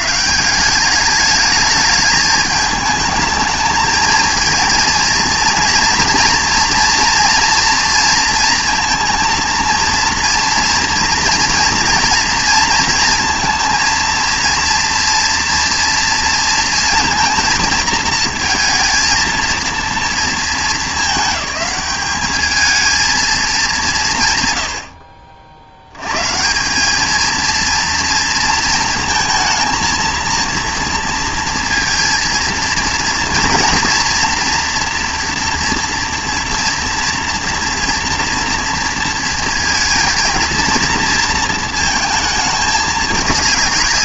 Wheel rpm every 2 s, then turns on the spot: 170, 210, 230, 230, 230, 240, 230, 230, 230, 230, 220, 220, 100, 170, 230, 230, 230, 230, 230, 230, 230, 220.
none